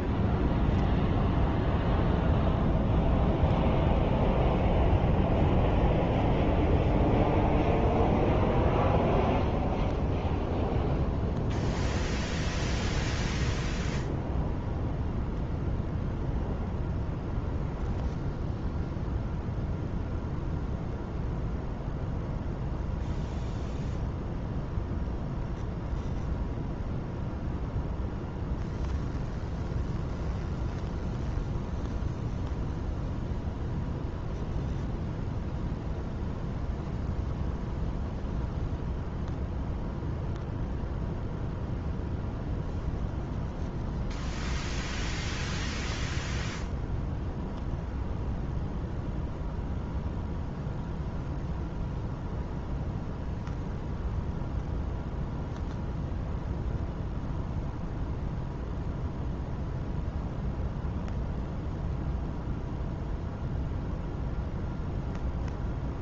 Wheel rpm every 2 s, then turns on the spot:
0, 0, 0, 0, 0, 0, 0, 0, 0, 0, 0, 0, 0, 0, 0, 0, 0, 0, 0, 0, 0, 0, 0, 0, 0, 0, 0, 0, 0, 0, 0, 0, 0.
none